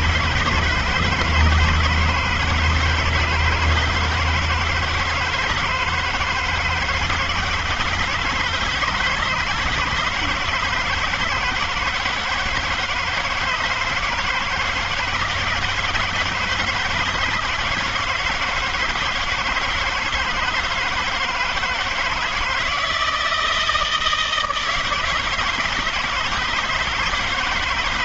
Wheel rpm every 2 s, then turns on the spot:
160, 170, 160, 160, 160, 170, 160, 160, 160, 160, 160, 160, 160, 160.
none